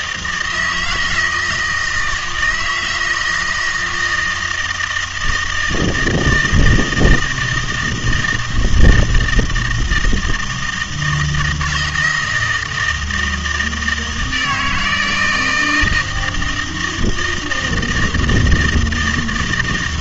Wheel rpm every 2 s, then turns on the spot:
160, 160, 160, 160, 160, 160, 160, 160, 170, 160.
none